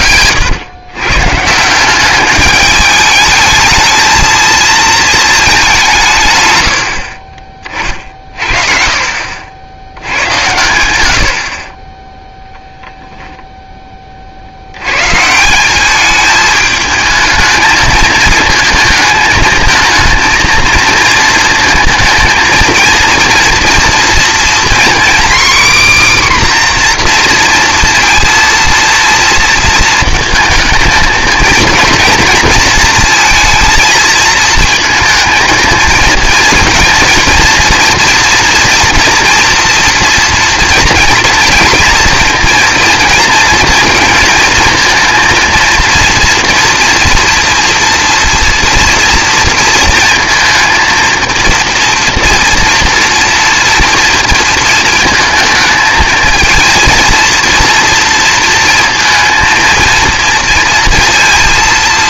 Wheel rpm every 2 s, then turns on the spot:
120, 210, 230, 100, 40, 90, 0, 90, 210, 220, 230, 230, 240, 260, 230, 220, 230, 220, 220, 230, 230, 230, 230, 230, 230, 230, 230, 220, 220, 230, 230.
none